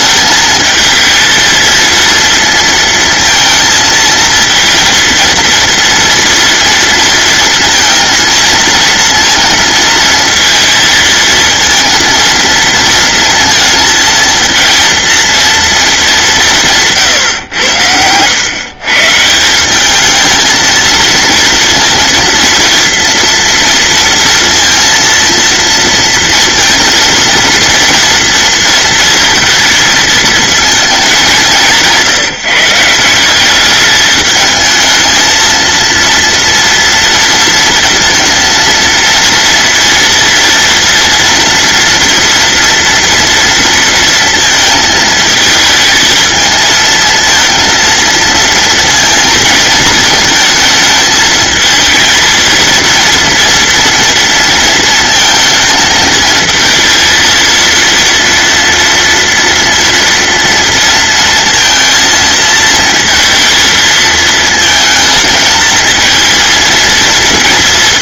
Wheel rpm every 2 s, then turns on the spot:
230, 220, 220, 230, 230, 230, 230, 230, 230, 120, 170, 230, 230, 230, 230, 230, 190, 190, 230, 230, 230, 240, 230, 220, 230, 230, 220, 240, 230, 230, 230, 230, 230, 220.
none